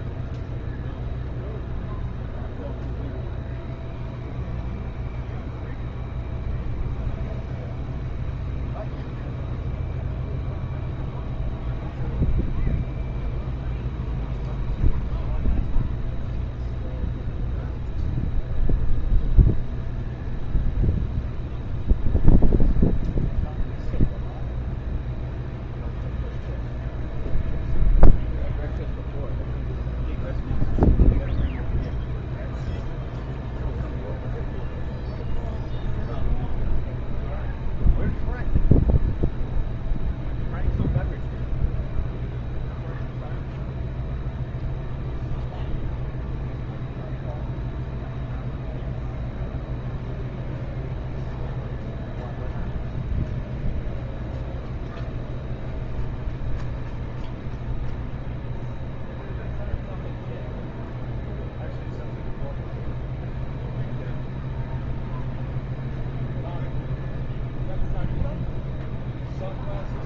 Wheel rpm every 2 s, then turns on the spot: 0, 0, 0, 0, 0, 0, 0, 0, 0, 0, 0, 0, 0, 0, 0, 0, 0, 0, 0, 0, 0, 0, 0, 0, 0, 0, 0, 0, 0, 0, 0, 0, 0, 0, 0.
none